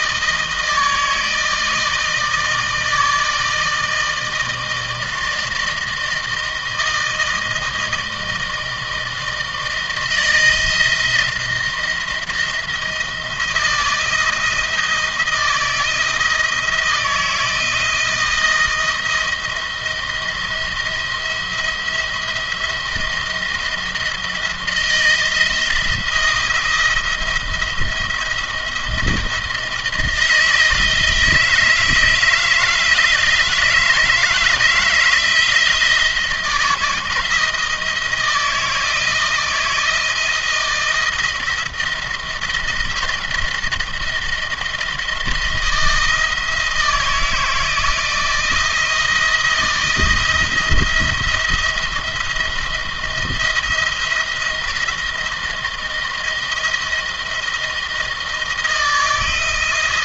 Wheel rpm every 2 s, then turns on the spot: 160, 160, 160, 160, 160, 160, 160, 170, 170, 160, 170, 170, 170, 170, 170, 160, 160, 160, 160, 160, 170, 170, 170, 160, 170, 170, 170, 170, 170, 160.
none